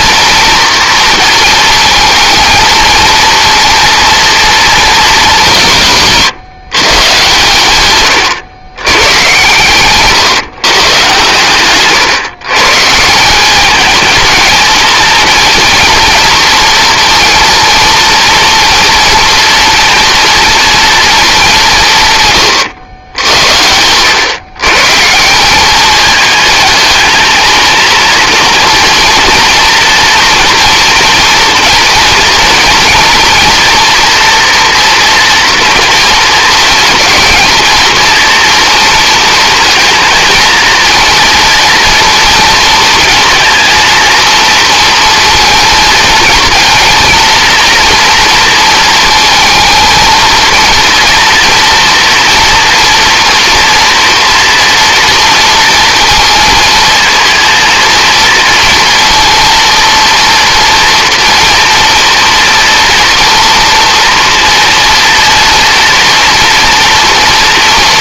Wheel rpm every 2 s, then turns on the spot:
230, 230, 220, 150, 120, 140, 150, 230, 240, 230, 230, 110, 150, 220, 230, 230, 230, 230, 220, 230, 230, 240, 230, 230, 230, 230, 240, 230, 220, 230, 230, 230, 230, 230.
none